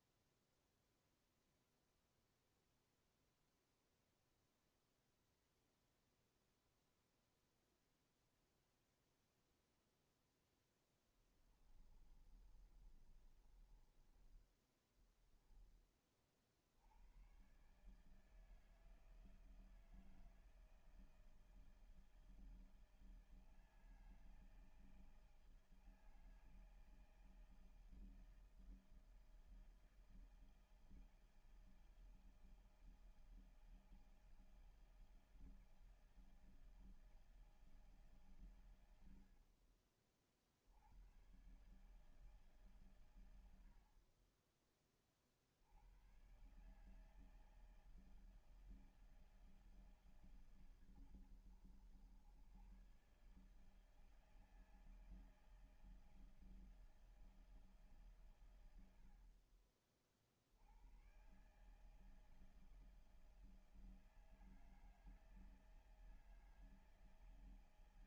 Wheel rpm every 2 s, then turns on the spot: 0, 0, 0, 0, 0, 0, 30, 20, 40, 150, 160, 160, 160, 160, 160, 160, 160, 160, 160, 130, 50, 150, 40, 120, 160, 140, 110, 160, 160, 120, 50, 160, 160, 160.
12-14